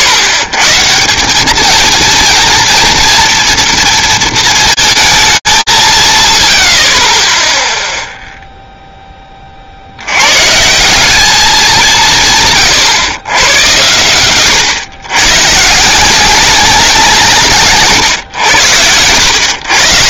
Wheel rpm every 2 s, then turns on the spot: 110, 230, 230, 70, 0, 170, 130, 120, 180, 90.
none